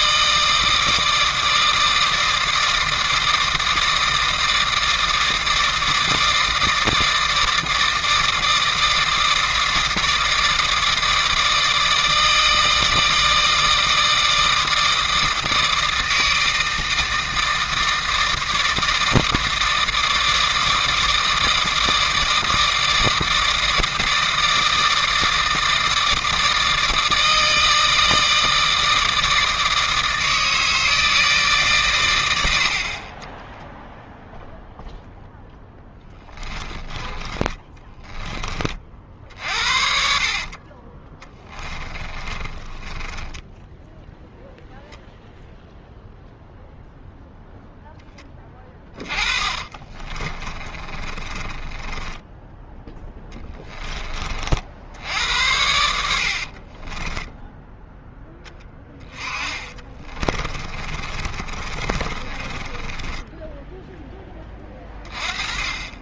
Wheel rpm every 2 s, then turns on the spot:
160, 160, 160, 160, 160, 160, 160, 160, 160, 160, 160, 160, 160, 160, 160, 160, 60, 0, 20, 40, 40, 20, 0, 0, 20, 30, 10, 60, 30, 10, 30, 20, 20.
36-38 40-44 48-52 56-58 60-64